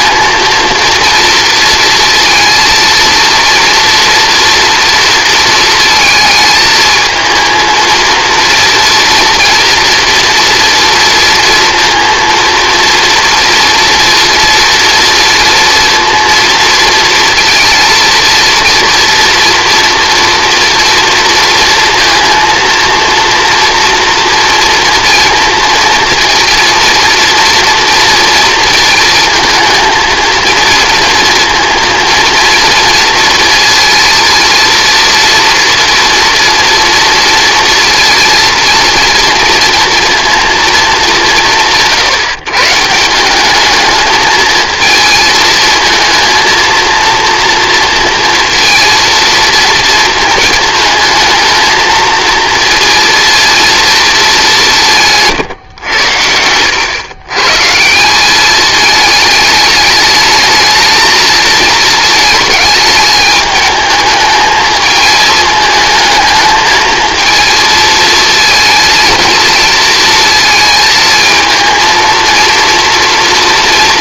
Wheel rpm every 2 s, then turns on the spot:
230, 230, 240, 220, 230, 230, 230, 230, 230, 230, 230, 230, 230, 230, 230, 230, 230, 230, 230, 230, 180, 160, 220, 230, 230, 220, 230, 170, 110, 210, 220, 220, 220, 220, 230, 220, 230.
none